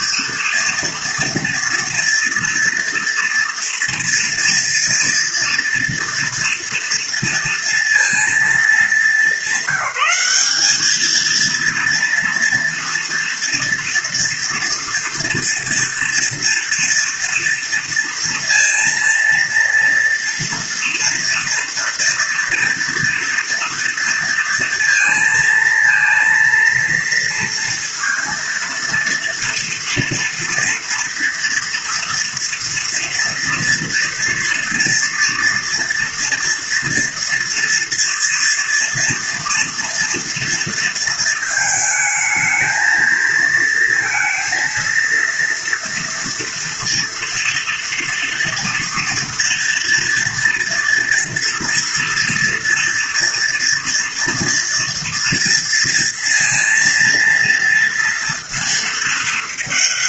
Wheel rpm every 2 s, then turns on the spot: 230, 230, 240, 230, 210, 200, 230, 230, 230, 230, 230, 230, 230, 230, 230, 240, 230, 240, 230, 230, 230, 220, 230, 230, 230, 230, 230, 230, 230, 230.
none